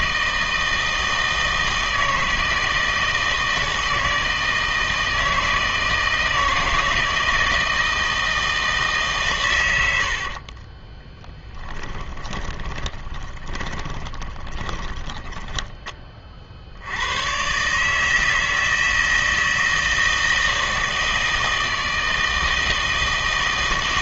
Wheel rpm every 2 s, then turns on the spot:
160, 160, 160, 160, 160, 30, 20, 20, 60, 160, 160, 160.
10-16